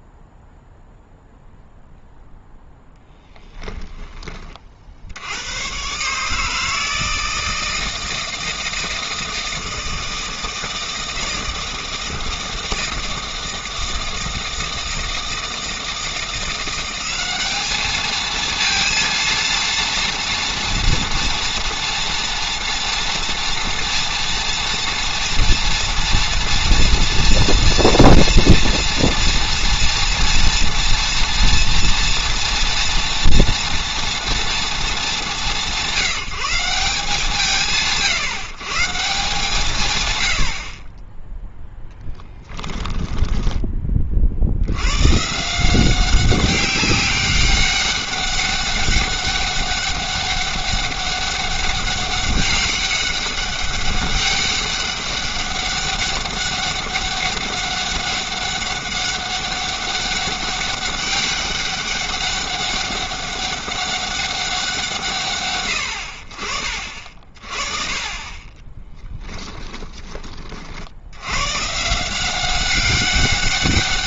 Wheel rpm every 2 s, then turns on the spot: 0, 10, 50, 160, 160, 160, 160, 160, 180, 230, 230, 240, 230, 230, 230, 230, 230, 190, 180, 160, 20, 10, 100, 200, 200, 200, 200, 200, 200, 200, 200, 200, 150, 50, 20, 60, 190.
42-44 68-70